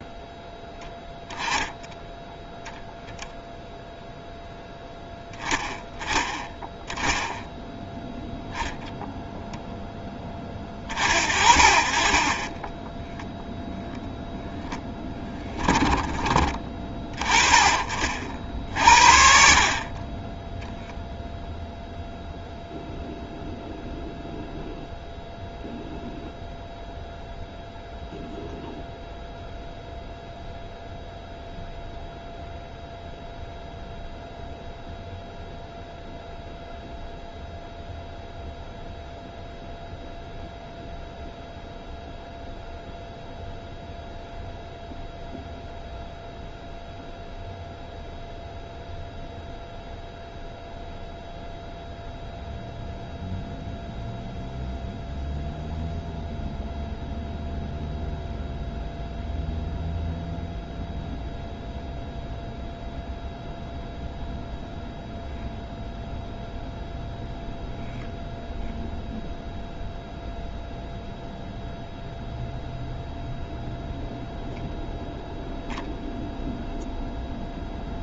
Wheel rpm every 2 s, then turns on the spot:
10, 0, 0, 10, 0, 30, 10, 10, 20, 50, 0, 0, 0, 0, 0, 0, 0, 0, 0, 0, 0, 0, 0, 0, 0, 0, 0, 0, 0, 0, 0, 0, 0, 0, 0, 0, 0, 0, 0.
12-16